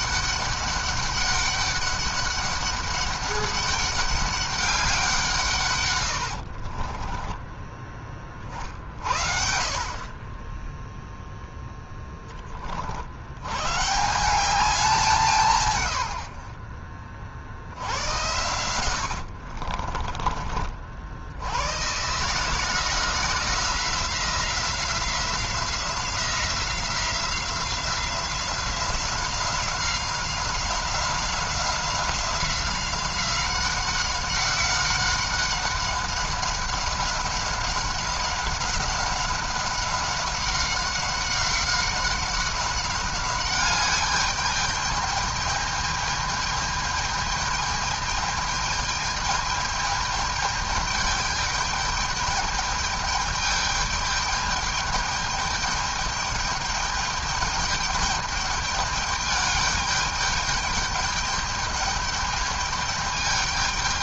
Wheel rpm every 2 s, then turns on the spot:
200, 200, 200, 60, 40, 20, 40, 190, 60, 90, 40, 150, 180, 180, 180, 190, 190, 190, 190, 200, 190, 190, 210, 210, 210, 210, 210, 210, 200, 210, 210, 210.
6-8 16-20